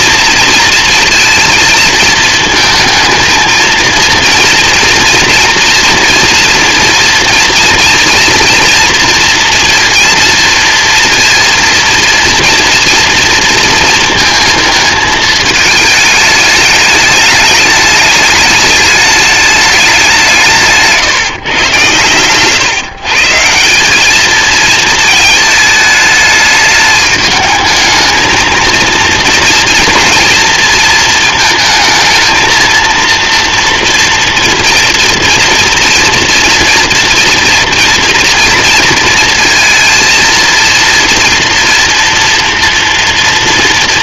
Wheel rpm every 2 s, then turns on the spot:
230, 220, 230, 230, 230, 230, 240, 220, 210, 210, 160, 140, 220, 210, 230, 230, 230, 240, 230, 230, 230, 240.
none